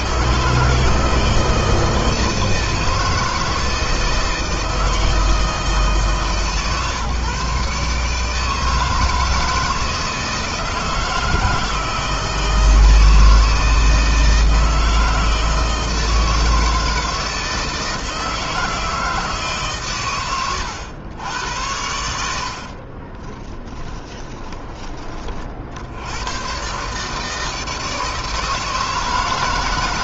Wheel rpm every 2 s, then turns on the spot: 160, 160, 160, 140, 160, 160, 160, 160, 160, 160, 90, 40, 30, 140, 160.
22-24